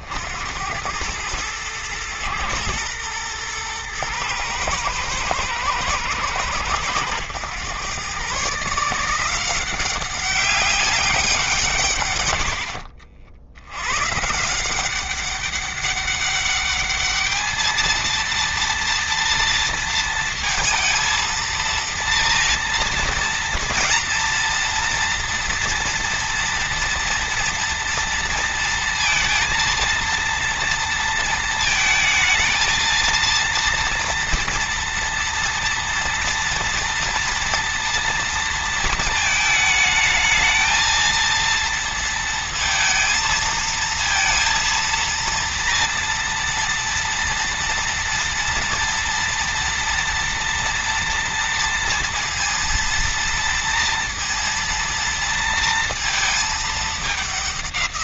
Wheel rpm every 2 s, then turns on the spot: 90, 110, 110, 110, 150, 200, 70, 180, 210, 240, 230, 230, 230, 230, 230, 230, 220, 230, 230, 220, 230, 230, 230, 230, 230, 230, 230, 230, 220.
none